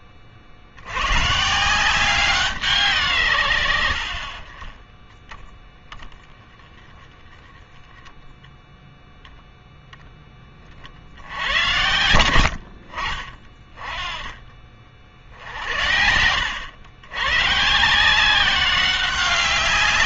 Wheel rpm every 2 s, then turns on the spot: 90, 150, 20, 10, 0, 50, 50, 50, 110, 190.
none